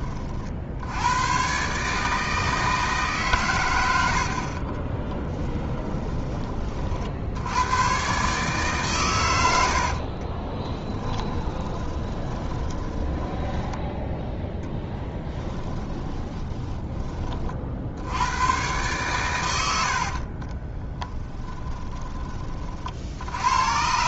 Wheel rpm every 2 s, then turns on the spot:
70, 150, 40, 40, 130, 20, 20, 0, 10, 120, 20, 40.
4-6 10-14 20-22